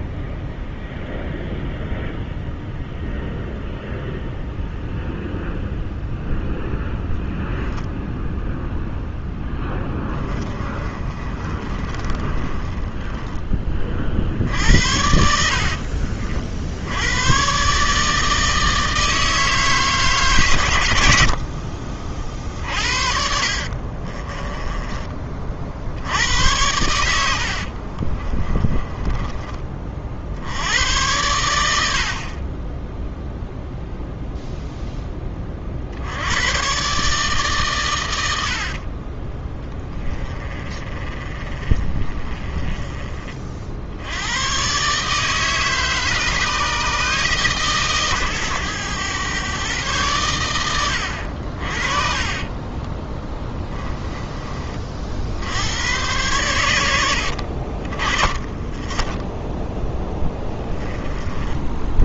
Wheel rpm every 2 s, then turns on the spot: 0, 0, 0, 0, 0, 30, 20, 80, 80, 160, 100, 50, 20, 90, 20, 90, 10, 0, 130, 50, 30, 30, 140, 150, 110, 90, 20, 40, 80, 10, 20.
10-14 22-24 28-30 38-42 52-54